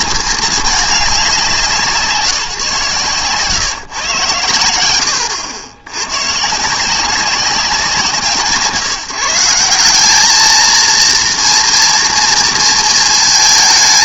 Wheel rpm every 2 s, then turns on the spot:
200, 140, 100, 170, 160, 230, 230.
none